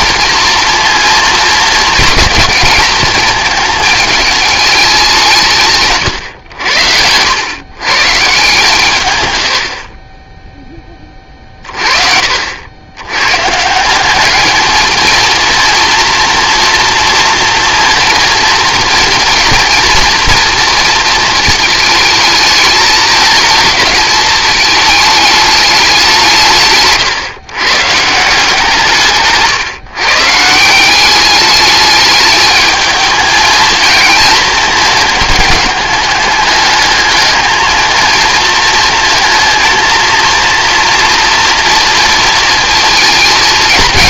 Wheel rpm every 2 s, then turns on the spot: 230, 230, 210, 90, 130, 20, 100, 220, 230, 230, 230, 220, 210, 140, 160, 180, 220, 220, 210, 230, 240, 220.
none